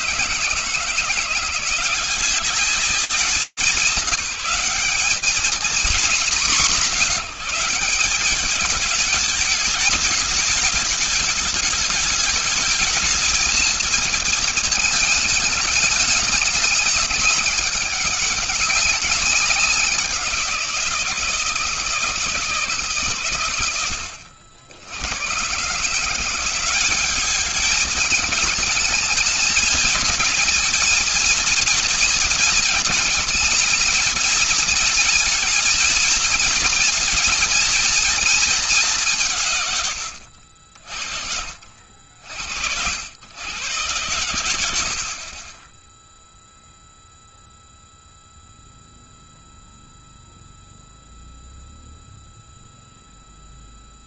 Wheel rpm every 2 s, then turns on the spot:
160, 210, 210, 190, 210, 210, 220, 220, 200, 190, 160, 110, 140, 220, 230, 230, 220, 230, 240, 120, 60, 110, 20, 0, 0, 0, 0.
none